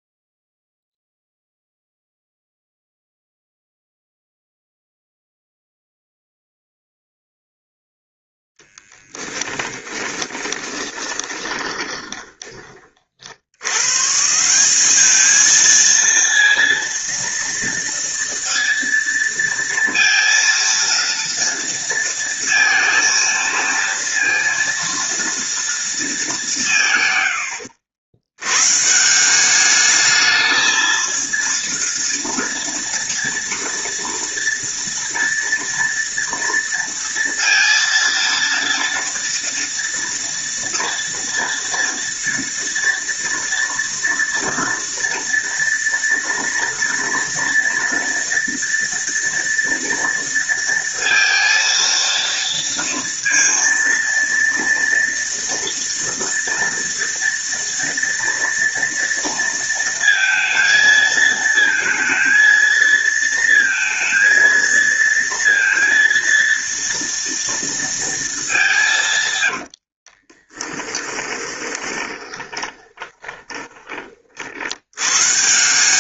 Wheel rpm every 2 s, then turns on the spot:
0, 0, 0, 0, 10, 20, 40, 190, 230, 230, 230, 230, 230, 160, 130, 220, 230, 230, 230, 230, 230, 230, 230, 230, 230, 230, 230, 230, 230, 230, 230, 230, 230, 230, 180, 20, 20, 80.
8-12 70-74